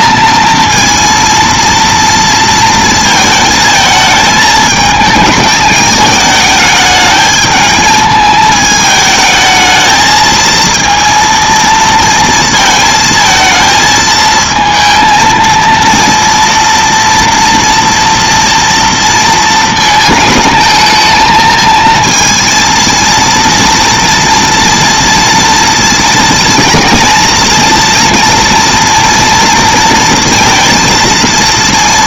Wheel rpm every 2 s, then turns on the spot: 230, 230, 220, 210, 220, 230, 220, 230, 230, 230, 220, 230, 230, 230, 230, 230.
none